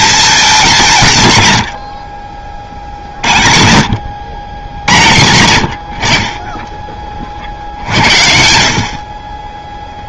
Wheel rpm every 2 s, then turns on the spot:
180, 40, 80, 20, 50.
none